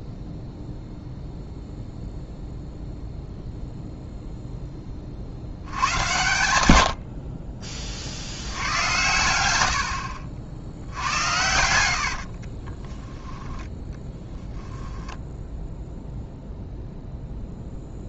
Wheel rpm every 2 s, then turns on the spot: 0, 0, 10, 90, 90, 70, 30, 0, 0.
10-14